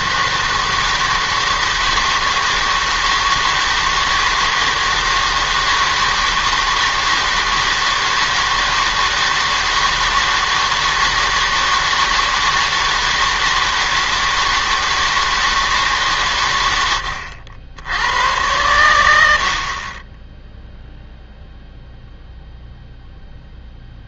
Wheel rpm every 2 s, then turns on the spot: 160, 160, 160, 160, 160, 160, 160, 160, 120, 100, 0, 0.
none